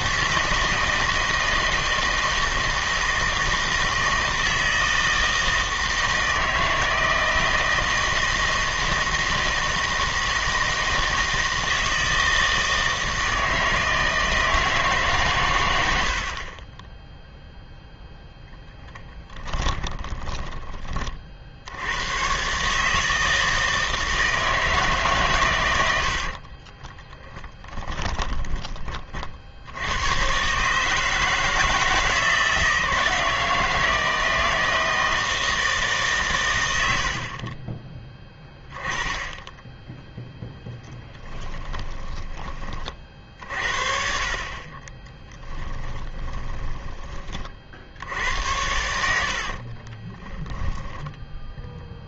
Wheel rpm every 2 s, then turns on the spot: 160, 160, 160, 160, 160, 160, 160, 160, 20, 10, 20, 140, 160, 30, 20, 140, 160, 160, 110, 10, 10, 30, 30, 20, 80, 0.
26-28 40-42 46-50